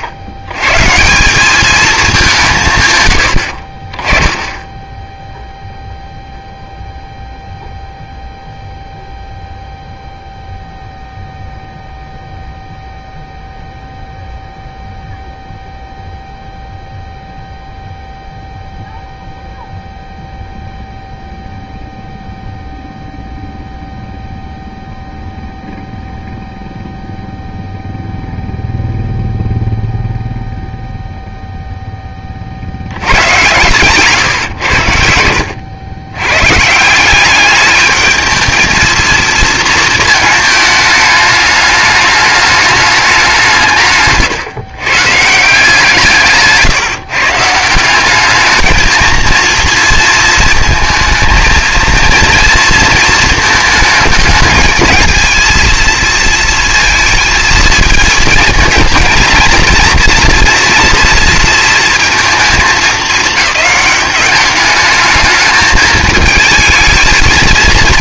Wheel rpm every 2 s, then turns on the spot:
130, 150, 10, 0, 0, 0, 0, 0, 0, 0, 0, 0, 0, 0, 0, 0, 60, 110, 140, 220, 220, 210, 130, 150, 220, 230, 230, 220, 230, 220, 240, 220, 210, 220.
4-6